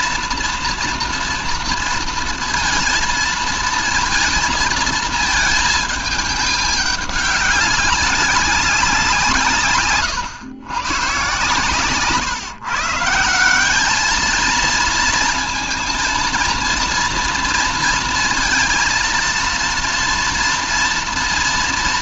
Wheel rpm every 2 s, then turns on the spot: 240, 230, 230, 210, 190, 120, 140, 230, 230, 230, 240.
none